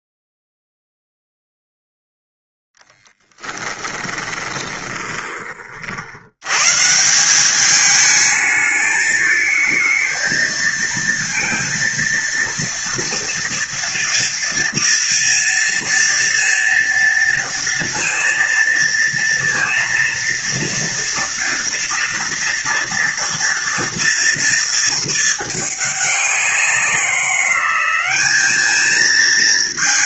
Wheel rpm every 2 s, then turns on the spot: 0, 0, 20, 130, 210, 230, 230, 230, 230, 230, 230, 230, 230, 180, 220.
4-6